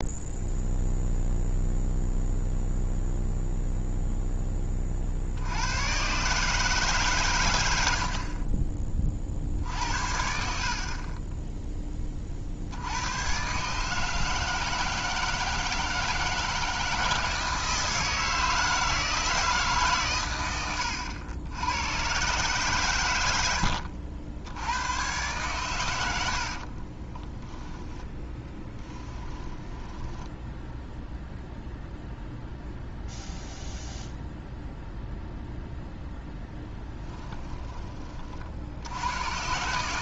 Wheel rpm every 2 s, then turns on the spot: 0, 0, 40, 140, 30, 50, 80, 160, 160, 160, 100, 120, 100, 40, 10, 0, 0, 0, 10, 70.
20-22 26-30 36-38